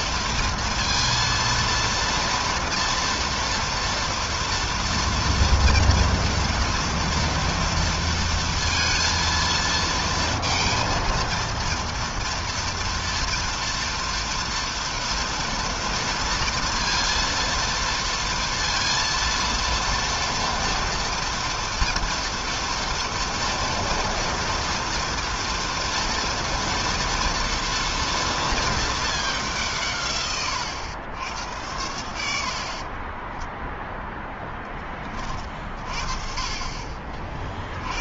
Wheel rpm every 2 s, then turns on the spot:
230, 230, 240, 230, 230, 230, 230, 230, 230, 230, 230, 230, 230, 230, 190, 90, 10, 40, 50.
32-34